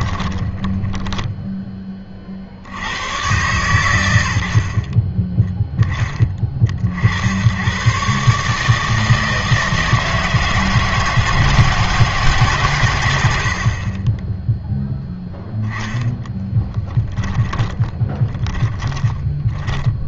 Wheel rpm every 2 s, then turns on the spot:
20, 70, 60, 40, 150, 160, 130, 0, 10, 10.
0-2 16-20